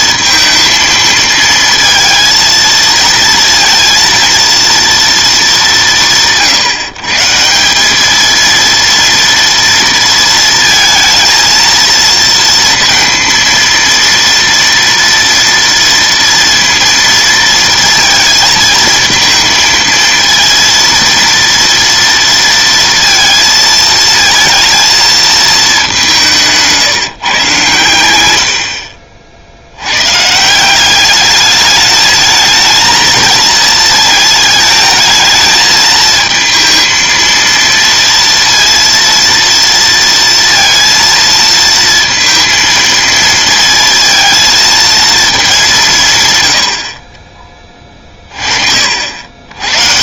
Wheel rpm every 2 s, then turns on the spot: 220, 230, 230, 140, 230, 230, 230, 230, 230, 220, 230, 230, 220, 160, 50, 180, 220, 220, 220, 230, 230, 230, 230, 70, 60.
none